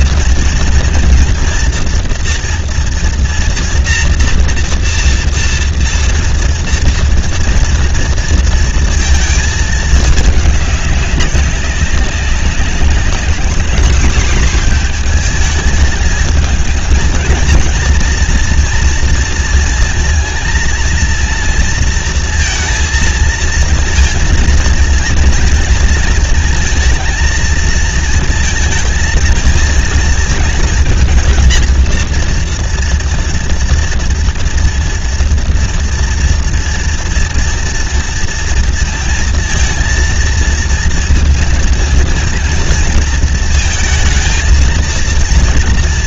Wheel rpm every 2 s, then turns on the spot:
240, 230, 230, 230, 230, 210, 190, 230, 220, 230, 230, 230, 230, 230, 230, 230, 230, 230, 230, 230, 230, 230, 230.
none